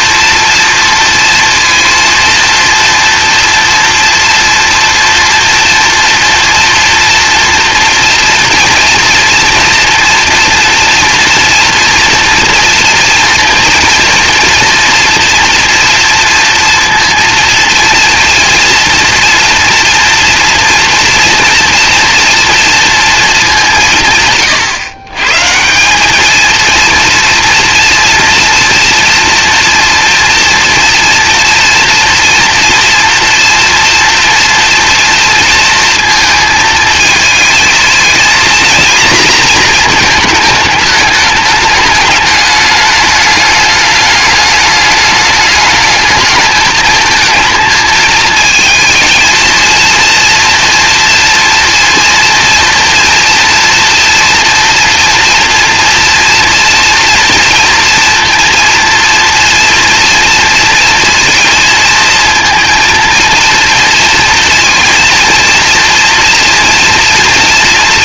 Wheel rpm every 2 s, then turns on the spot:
230, 230, 230, 230, 230, 230, 230, 240, 230, 230, 230, 230, 120, 230, 240, 230, 230, 230, 220, 240, 220, 210, 210, 220, 220, 230, 230, 230, 230, 230, 230, 230, 230, 230.
none